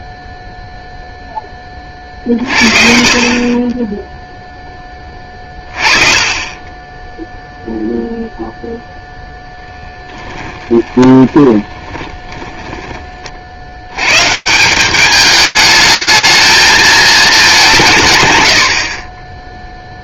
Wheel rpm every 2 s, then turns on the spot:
0, 50, 20, 10, 0, 20, 90, 220, 170, 40.
10-12